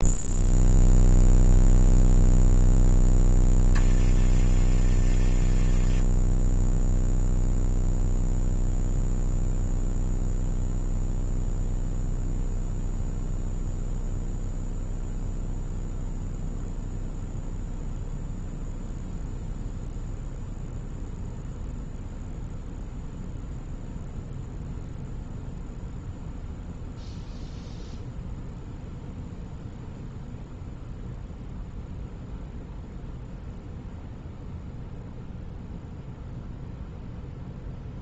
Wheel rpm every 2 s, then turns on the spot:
0, 10, 20, 0, 0, 0, 0, 0, 0, 0, 0, 0, 0, 0, 0, 0, 0, 0, 0.
none